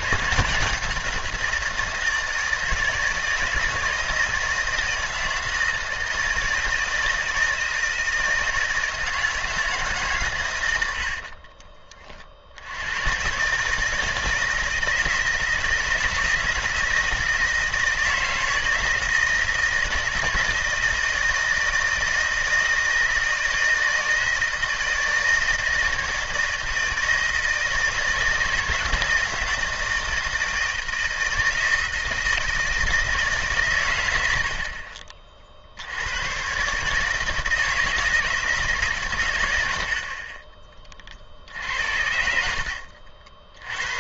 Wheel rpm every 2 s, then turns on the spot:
170, 160, 160, 160, 160, 110, 80, 160, 160, 160, 160, 160, 160, 160, 160, 160, 160, 70, 130, 150, 30, 70.
none